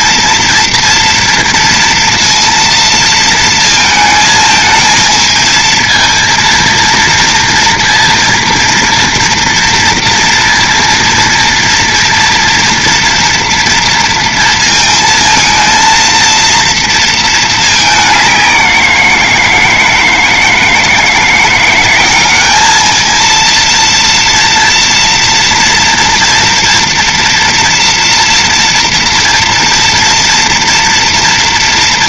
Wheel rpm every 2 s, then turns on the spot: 230, 230, 220, 230, 230, 230, 230, 230, 230, 180, 160, 210, 230, 230, 240, 230.
none